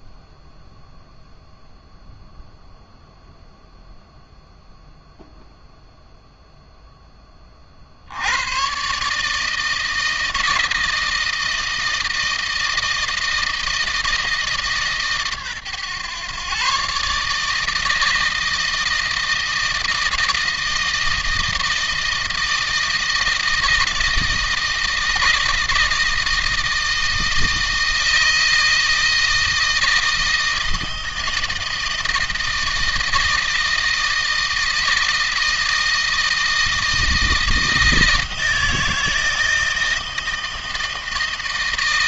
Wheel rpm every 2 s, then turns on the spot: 0, 0, 0, 10, 130, 160, 160, 140, 140, 160, 160, 160, 160, 160, 160, 160, 160, 160, 160, 160, 160.
none